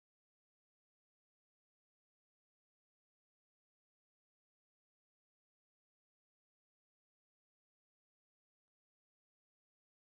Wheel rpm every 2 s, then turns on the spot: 0, 0, 0, 0, 0.
none